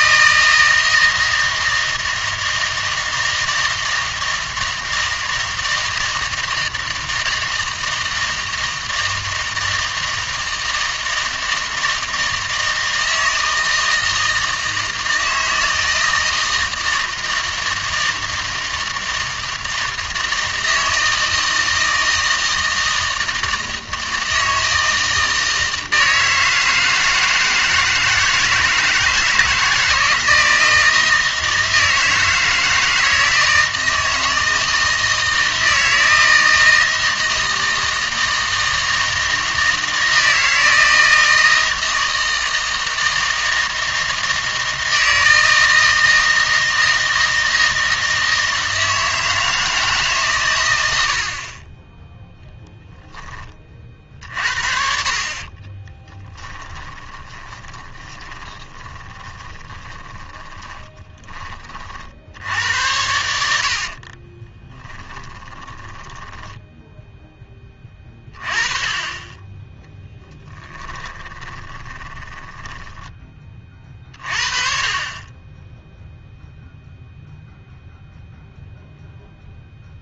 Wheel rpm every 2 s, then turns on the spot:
160, 160, 160, 160, 160, 160, 160, 160, 160, 160, 160, 160, 160, 160, 160, 160, 160, 160, 160, 160, 160, 160, 160, 160, 160, 110, 0, 50, 10, 20, 30, 90, 10, 0, 20, 10, 10, 40, 0, 0.
56-62 64-66 70-74